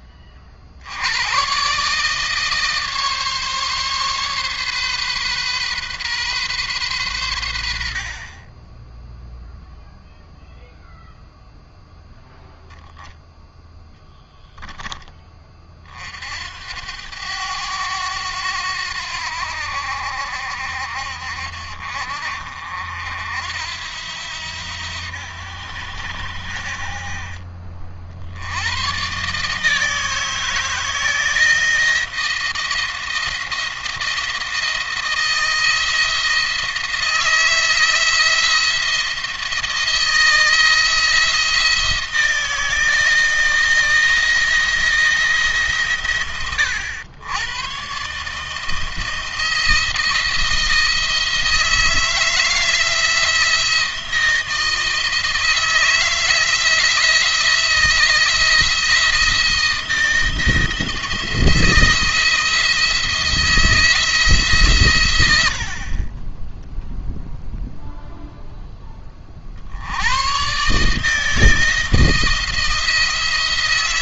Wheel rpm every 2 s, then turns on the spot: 60, 150, 130, 120, 10, 0, 0, 10, 80, 90, 70, 60, 80, 60, 90, 160, 170, 160, 160, 160, 160, 160, 170, 100, 160, 170, 160, 160, 160, 170, 170, 170, 130, 0, 10, 140, 170.
none